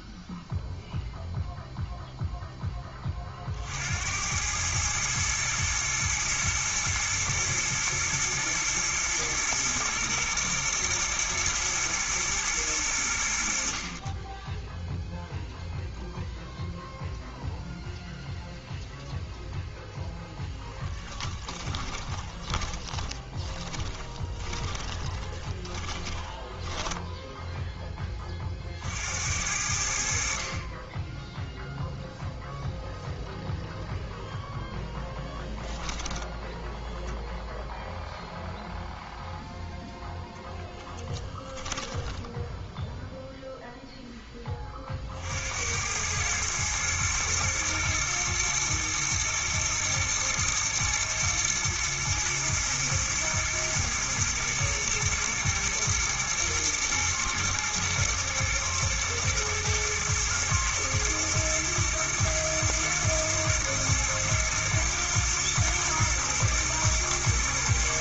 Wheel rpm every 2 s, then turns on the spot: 0, 20, 110, 110, 110, 110, 100, 0, 0, 0, 10, 20, 20, 10, 50, 20, 0, 0, 0, 0, 10, 10, 30, 110, 120, 120, 120, 120, 120, 120, 120, 120, 120, 120.
20-28 40-42